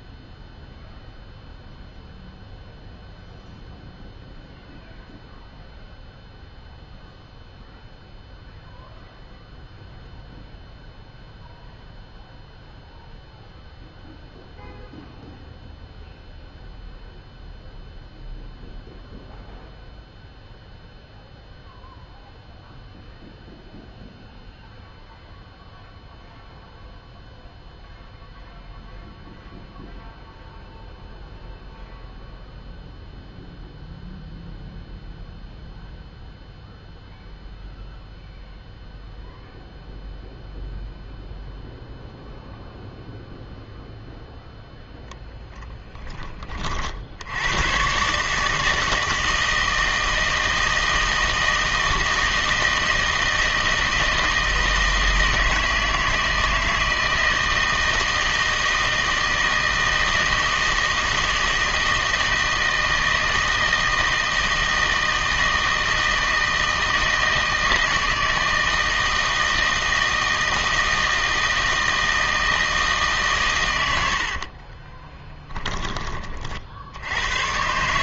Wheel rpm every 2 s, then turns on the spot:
0, 0, 0, 0, 0, 0, 0, 0, 0, 0, 0, 0, 0, 0, 0, 0, 0, 0, 0, 0, 0, 0, 0, 40, 160, 160, 160, 160, 160, 160, 160, 160, 160, 160, 160, 160, 160, 40, 50.
74-76